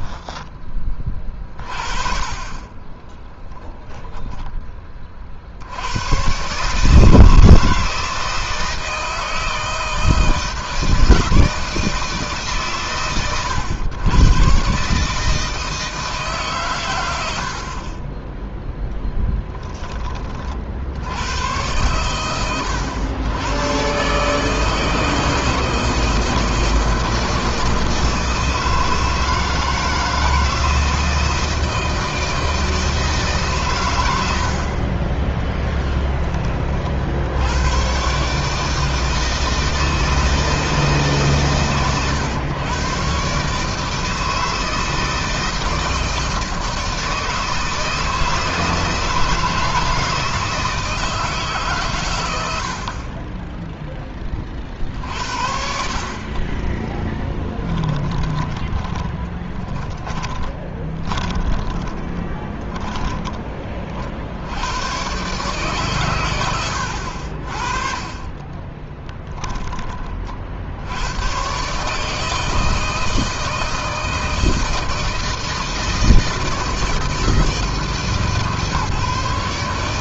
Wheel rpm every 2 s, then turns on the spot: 20, 20, 20, 150, 160, 160, 130, 140, 140, 0, 60, 100, 160, 160, 160, 160, 160, 50, 50, 160, 150, 130, 160, 160, 160, 160, 40, 50, 20, 10, 20, 20, 110, 90, 20, 80, 160, 160, 160, 150.
2-4 56-64 68-70